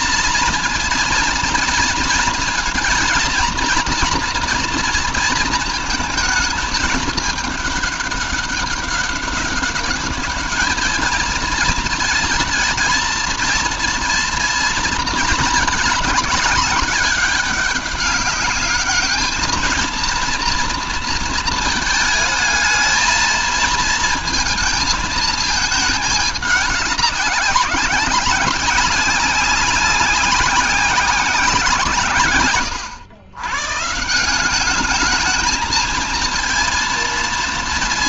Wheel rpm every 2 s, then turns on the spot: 230, 230, 230, 220, 200, 210, 220, 230, 210, 210, 230, 220, 220, 200, 180, 190, 110, 200, 230.
none